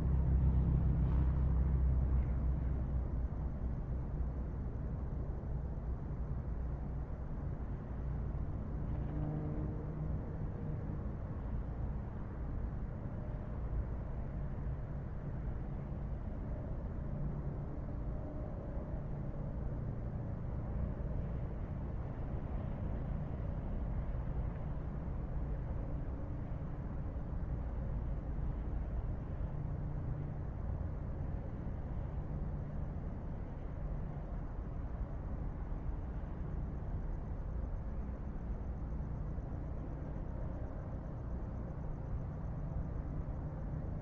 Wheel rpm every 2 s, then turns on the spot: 0, 0, 0, 0, 0, 0, 0, 0, 0, 0, 0, 0, 0, 0, 0, 0, 0, 0, 0, 0, 0, 0.
none